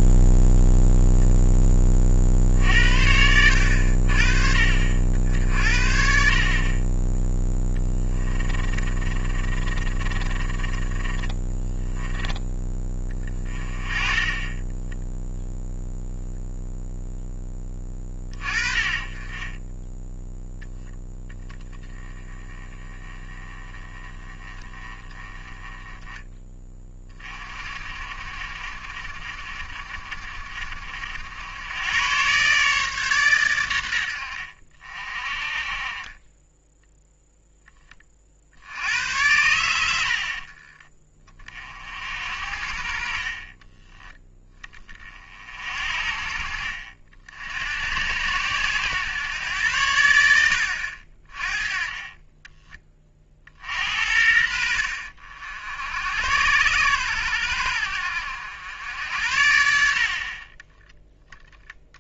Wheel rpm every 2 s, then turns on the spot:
0, 60, 60, 30, 30, 20, 20, 10, 0, 30, 0, 10, 20, 20, 50, 50, 140, 60, 10, 70, 30, 50, 30, 50, 110, 80, 20, 60, 100, 80, 20.
8-12 50-52